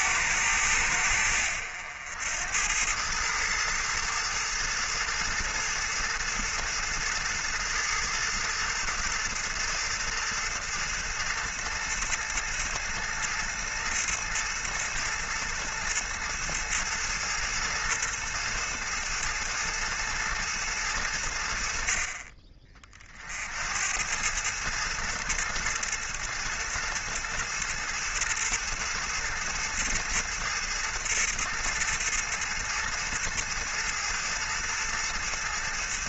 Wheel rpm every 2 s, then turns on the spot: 100, 90, 110, 110, 110, 110, 110, 110, 110, 110, 110, 40, 110, 110, 110, 110, 110, 110.
none